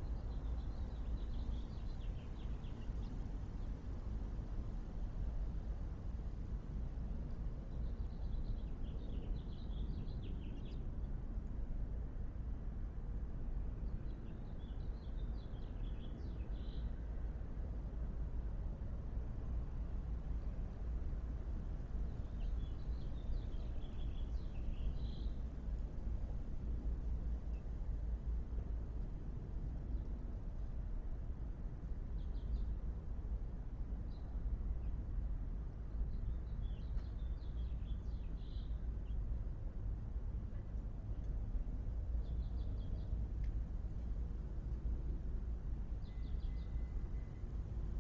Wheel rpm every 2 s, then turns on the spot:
0, 0, 0, 0, 0, 0, 0, 0, 0, 0, 0, 0, 0, 0, 0, 0, 0, 0, 0, 0, 0, 0, 0, 0.
none